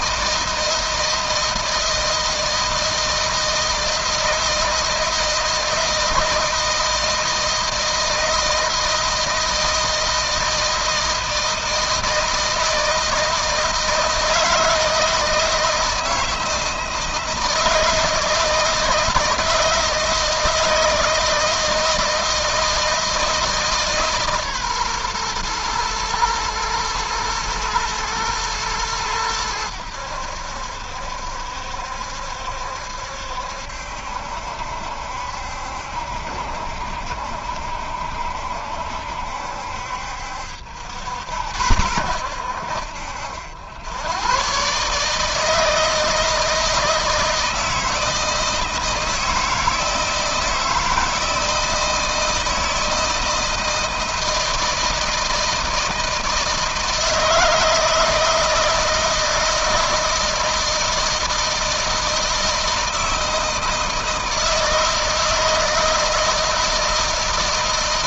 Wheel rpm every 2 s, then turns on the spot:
160, 160, 160, 160, 160, 160, 160, 160, 160, 160, 160, 160, 140, 110, 110, 80, 70, 70, 70, 70, 70, 80, 120, 160, 160, 160, 160, 160, 160, 160, 160, 160, 160, 160.
none